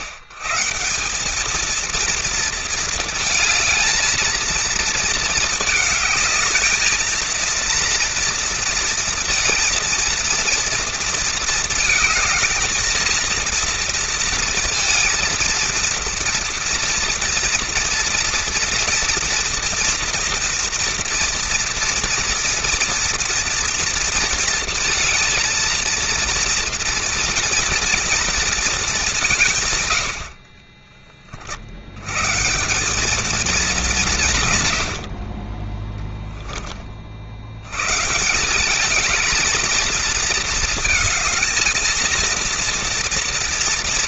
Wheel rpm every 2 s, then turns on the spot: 130, 230, 220, 220, 230, 230, 220, 230, 240, 230, 230, 230, 230, 230, 230, 40, 170, 120, 10, 180, 220, 230.
none